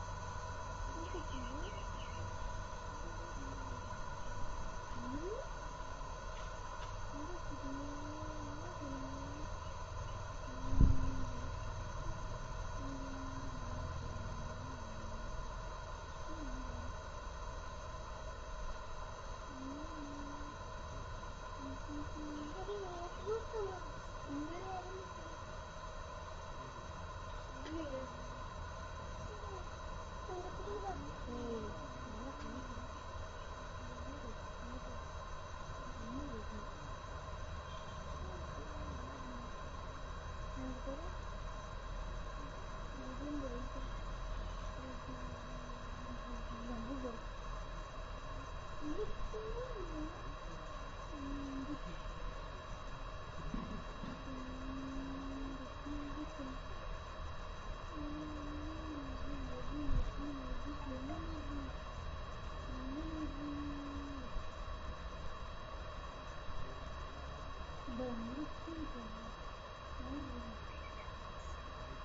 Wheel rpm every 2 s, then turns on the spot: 0, 0, 0, 0, 0, 0, 0, 0, 0, 0, 0, 0, 0, 0, 0, 0, 0, 0, 0, 0, 0, 0, 0, 0, 0, 0, 0, 0, 0, 0, 0, 0, 0, 0, 0, 0.
none